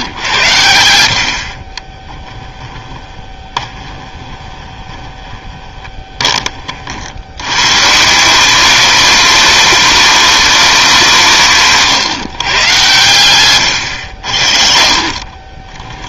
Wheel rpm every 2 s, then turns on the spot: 90, 20, 20, 40, 200, 190, 120, 60.
2-6 14-16